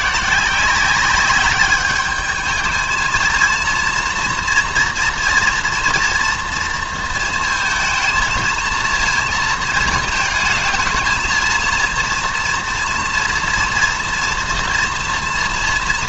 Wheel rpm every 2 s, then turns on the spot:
180, 220, 230, 230, 220, 220, 230, 240.
none